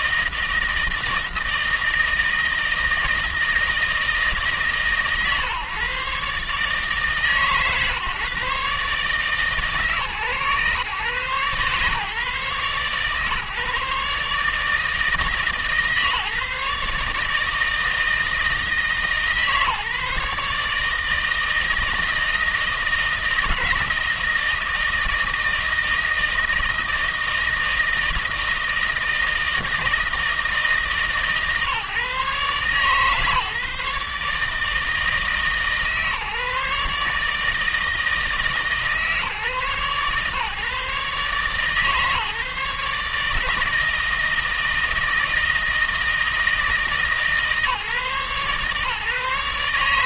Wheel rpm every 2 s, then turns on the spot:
160, 160, 150, 140, 140, 140, 140, 150, 150, 160, 150, 160, 160, 160, 160, 150, 130, 160, 150, 140, 130, 150, 160, 160, 140.
none